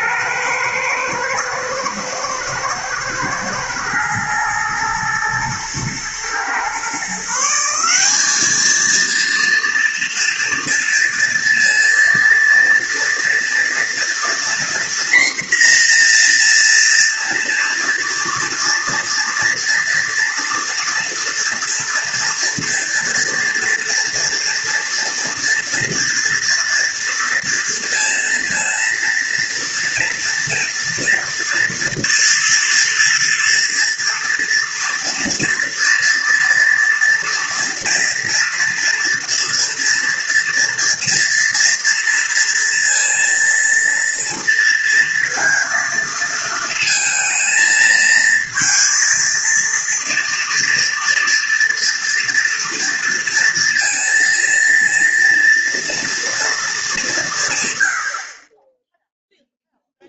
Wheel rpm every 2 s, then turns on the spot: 110, 110, 110, 130, 220, 230, 230, 240, 230, 230, 230, 230, 230, 230, 230, 230, 230, 230, 230, 230, 230, 230, 230, 220, 230, 230, 230, 230, 230, 20.
none